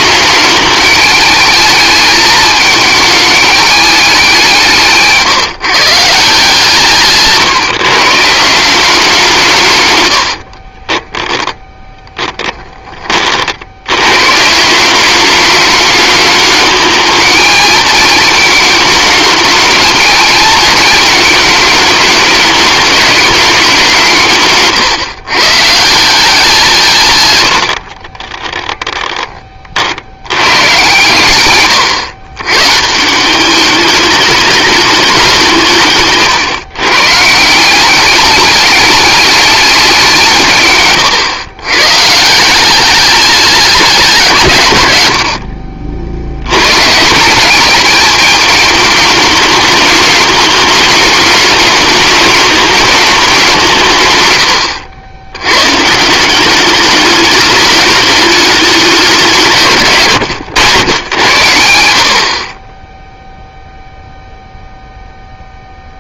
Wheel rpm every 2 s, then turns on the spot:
210, 220, 170, 150, 180, 30, 20, 190, 210, 220, 220, 210, 140, 160, 10, 120, 150, 210, 130, 210, 130, 200, 120, 140, 210, 210, 210, 100, 210, 190, 110, 10, 0.
10-12 40-42